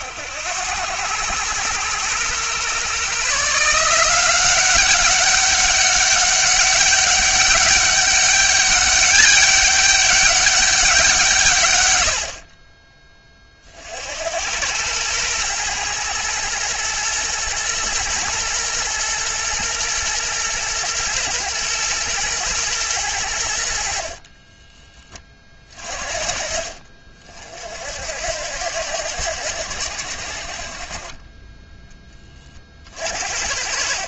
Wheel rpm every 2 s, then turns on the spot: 100, 140, 190, 200, 200, 190, 20, 100, 120, 120, 120, 110, 20, 50, 90, 40, 40.
none